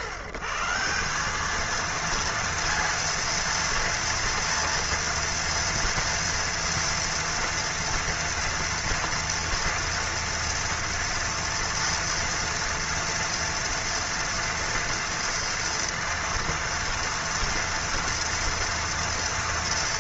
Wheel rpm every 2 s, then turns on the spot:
140, 230, 230, 230, 230, 230, 230, 230, 230, 230.
none